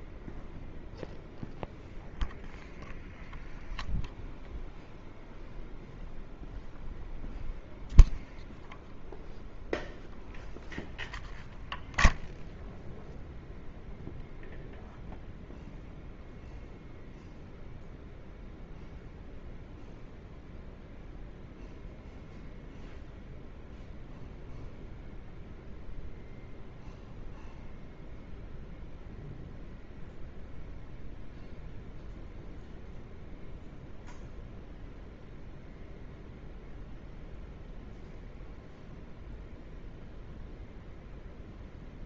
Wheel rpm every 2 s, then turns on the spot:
0, 0, 0, 0, 0, 0, 0, 0, 0, 0, 0, 0, 0, 0, 0, 0, 0, 0, 0, 0, 0.
none